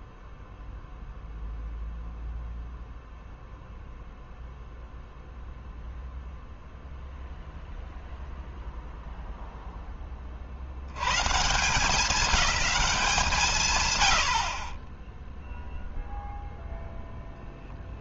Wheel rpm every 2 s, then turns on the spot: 0, 0, 0, 0, 0, 90, 190, 20, 0.
none